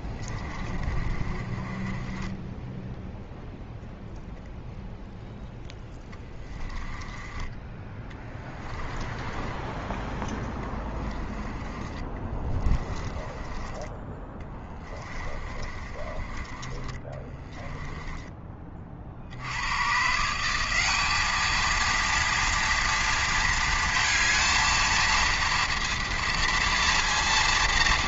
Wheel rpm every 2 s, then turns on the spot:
30, 10, 0, 10, 10, 10, 20, 20, 20, 30, 180, 240, 230, 230.
0-4 6-18